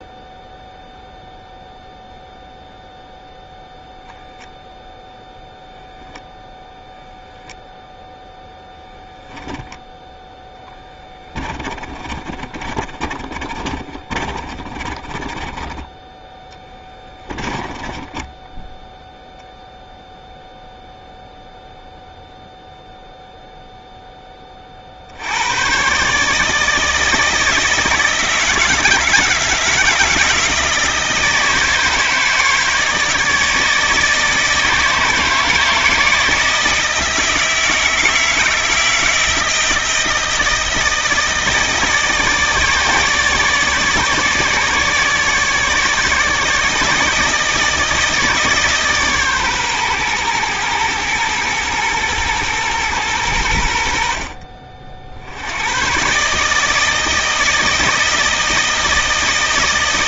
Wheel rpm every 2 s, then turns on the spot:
0, 0, 0, 0, 0, 20, 30, 30, 10, 10, 0, 0, 40, 160, 160, 160, 160, 160, 160, 160, 160, 160, 150, 160, 150, 120, 110, 50, 160, 160.
10-18